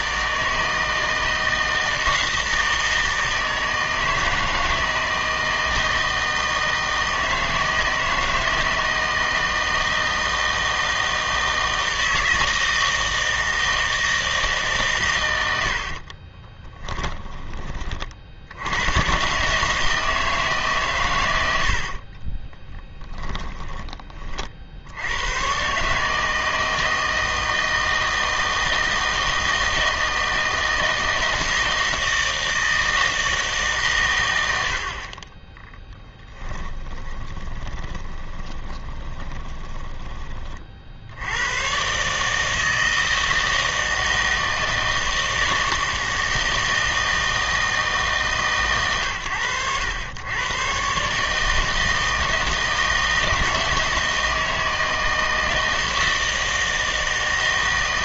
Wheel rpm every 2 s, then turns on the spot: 160, 160, 160, 160, 160, 160, 160, 150, 20, 100, 140, 10, 70, 160, 160, 160, 160, 60, 10, 20, 50, 160, 160, 160, 130, 120, 160, 160, 160.
16-18 22-24 36-40